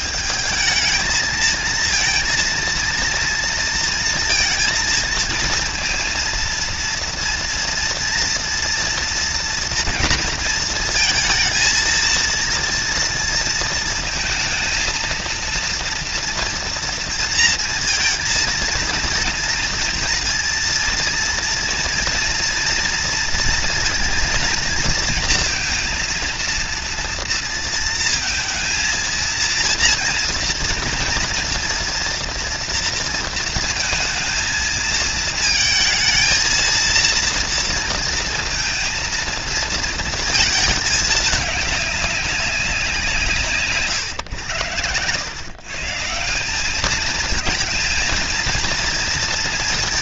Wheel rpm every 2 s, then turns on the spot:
220, 230, 230, 230, 230, 230, 230, 230, 230, 230, 230, 240, 230, 230, 230, 230, 230, 230, 230, 230, 210, 180, 110, 210, 230.
none